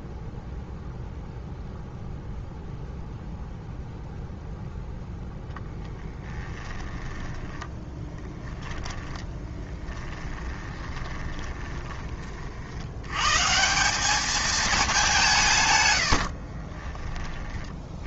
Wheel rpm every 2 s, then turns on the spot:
0, 0, 0, 20, 10, 20, 90, 210, 20.
6-12 16-18